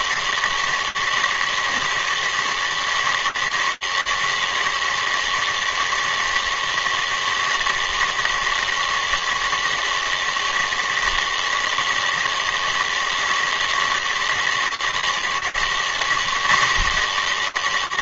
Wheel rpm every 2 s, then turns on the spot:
160, 160, 160, 160, 160, 160, 160, 160, 170.
none